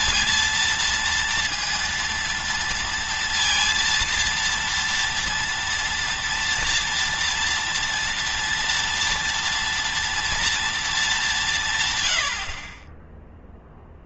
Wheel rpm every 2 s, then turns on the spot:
230, 230, 230, 230, 230, 210, 20.
none